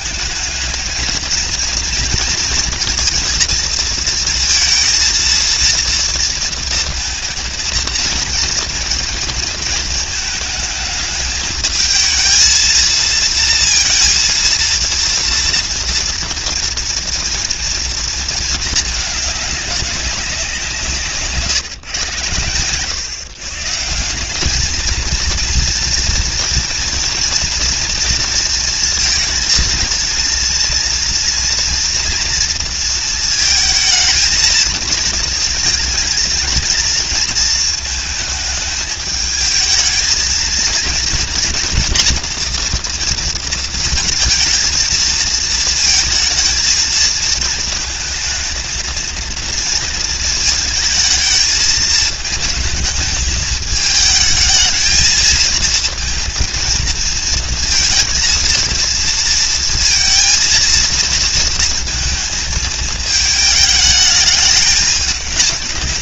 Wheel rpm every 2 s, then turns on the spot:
230, 230, 230, 230, 230, 220, 230, 230, 230, 210, 160, 120, 220, 240, 230, 230, 230, 230, 230, 220, 230, 230, 230, 220, 230, 220, 220, 220, 230, 230, 230, 220, 200.
none